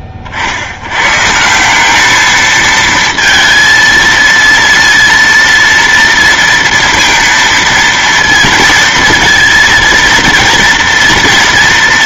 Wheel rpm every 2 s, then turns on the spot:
50, 220, 230, 230, 230, 230.
none